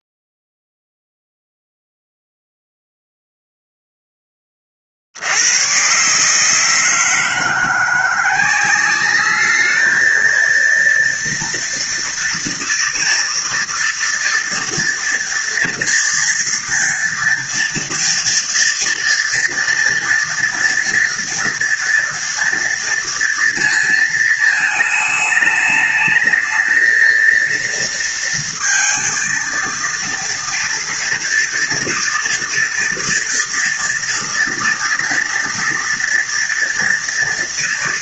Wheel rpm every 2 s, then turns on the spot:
0, 0, 70, 160, 210, 230, 230, 230, 230, 230, 230, 230, 220, 230, 230, 230, 230, 230, 230.
none